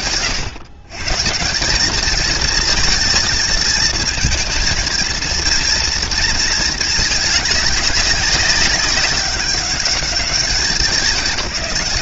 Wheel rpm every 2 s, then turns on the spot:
130, 230, 230, 210, 200, 200.
none